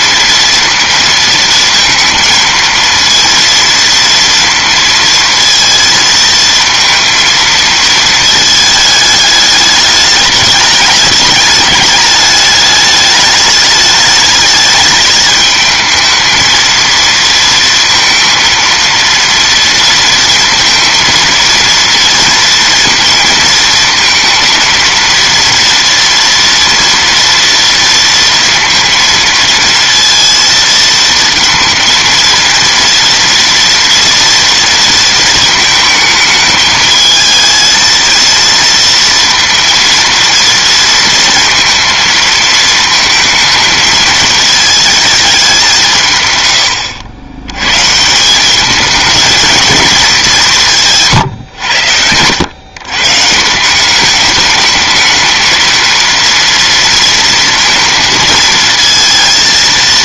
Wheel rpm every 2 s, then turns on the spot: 230, 230, 230, 230, 220, 210, 210, 210, 220, 230, 230, 230, 230, 230, 230, 230, 230, 230, 220, 230, 230, 220, 220, 110, 200, 190, 110, 210, 230, 230.
none